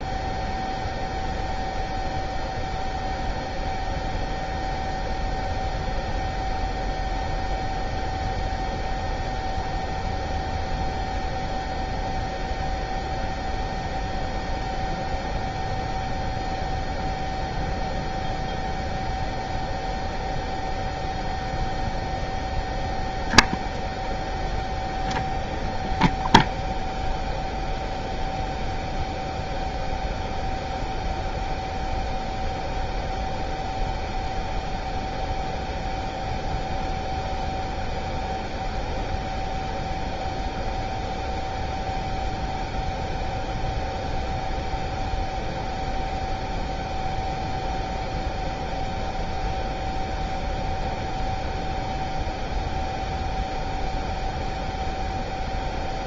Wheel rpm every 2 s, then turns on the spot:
0, 0, 0, 0, 0, 0, 0, 0, 0, 0, 0, 0, 0, 0, 0, 0, 0, 0, 0, 0, 0, 0, 0, 0, 0, 0, 0, 0.
none